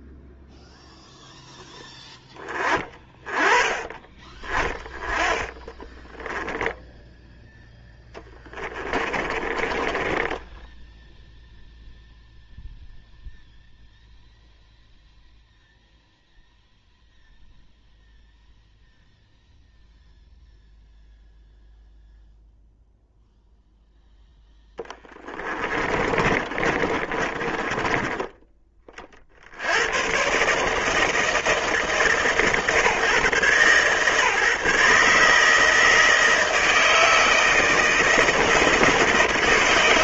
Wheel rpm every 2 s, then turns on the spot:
0, 20, 20, 0, 30, 0, 0, 0, 0, 0, 0, 0, 20, 30, 30, 160, 130, 150, 160, 160.
4-6 8-10 24-28